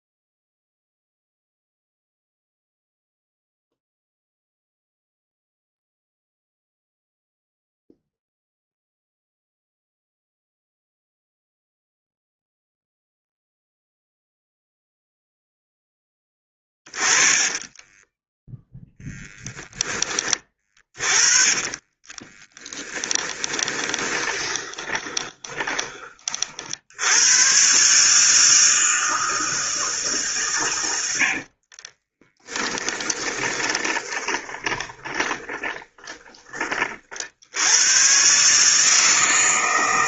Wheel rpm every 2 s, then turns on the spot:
0, 0, 0, 0, 0, 0, 0, 0, 20, 0, 20, 10, 20, 60, 160, 100, 10, 30, 30, 150.
16-18 20-26 32-36